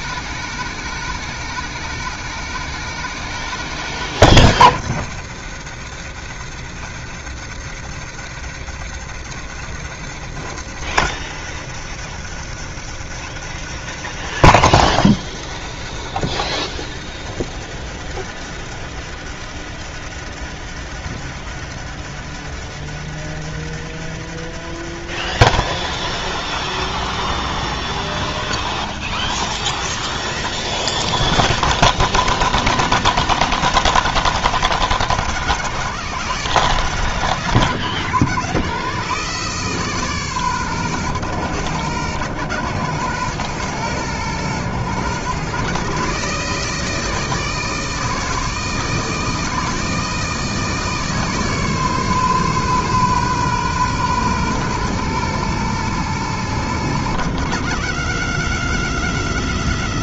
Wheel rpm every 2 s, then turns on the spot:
160, 160, 130, 100, 110, 110, 110, 110, 100, 110, 110, 110, 110, 110, 110, 110, 90, 90, 80, 110, 120, 110, 110, 160, 160, 150, 130, 120, 100, 90.
none